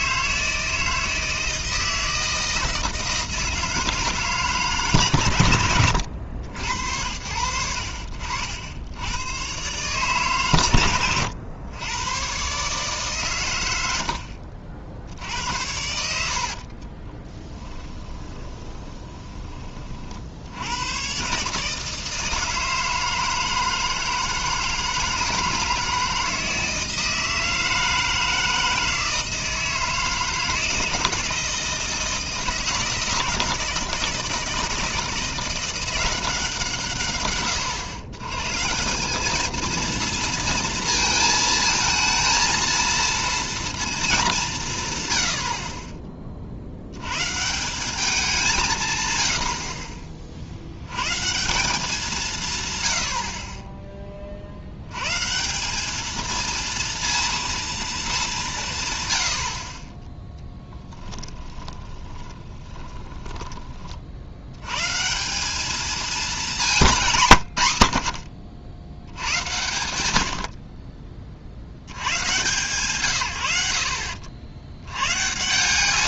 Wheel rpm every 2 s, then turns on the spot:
160, 160, 140, 80, 70, 120, 130, 70, 70, 20, 80, 160, 160, 160, 160, 160, 160, 160, 150, 150, 230, 230, 160, 60, 160, 80, 130, 60, 230, 160, 10, 20, 100, 190, 80, 50, 130, 80.
16-20 60-64